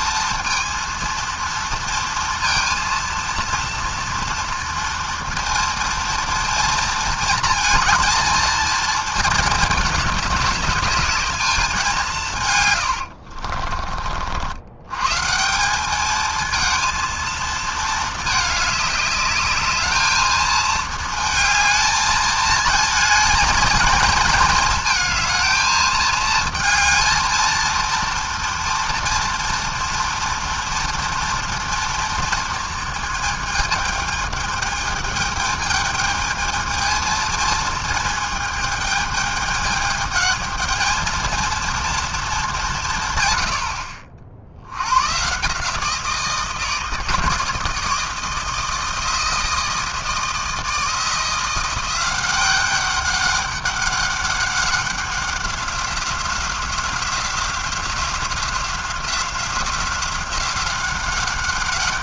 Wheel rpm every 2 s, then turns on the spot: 230, 230, 240, 230, 230, 210, 140, 80, 230, 210, 220, 220, 220, 220, 240, 230, 230, 220, 220, 220, 220, 200, 70, 160, 160, 160, 190, 190, 180, 180, 190.
none